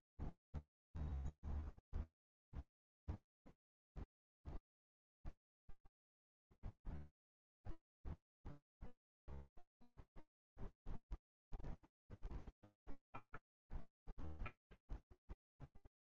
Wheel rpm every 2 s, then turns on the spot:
0, 0, 0, 0, 0, 0, 0, 0.
none